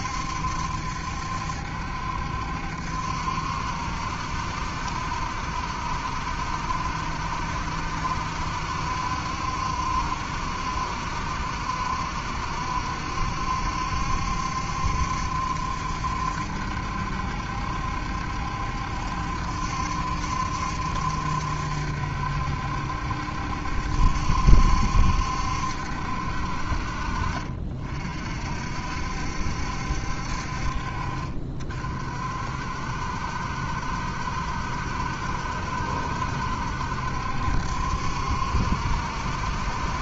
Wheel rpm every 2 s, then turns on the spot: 70, 70, 70, 70, 70, 60, 70, 70, 70, 70, 70, 70, 70, 50, 60, 50, 60, 70, 70, 70.
none